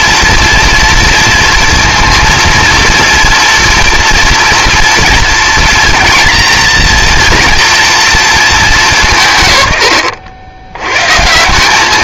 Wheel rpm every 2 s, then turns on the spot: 230, 230, 230, 230, 220, 100.
none